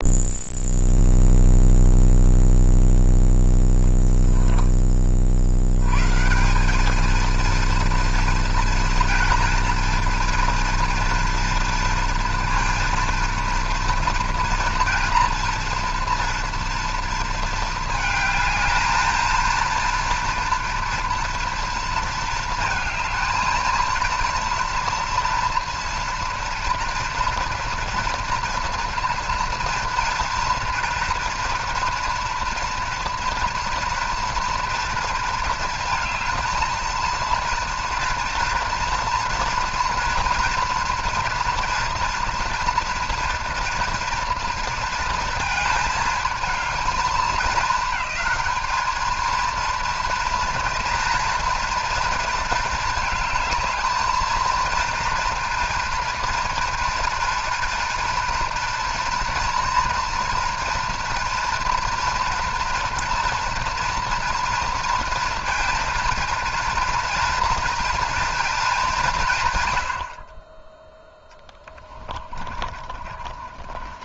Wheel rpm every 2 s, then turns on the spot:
0, 0, 20, 210, 230, 230, 230, 240, 240, 220, 230, 220, 230, 230, 230, 240, 230, 230, 230, 230, 230, 230, 230, 220, 220, 230, 220, 230, 240, 230, 230, 230, 230, 230, 200, 10, 30.
72-74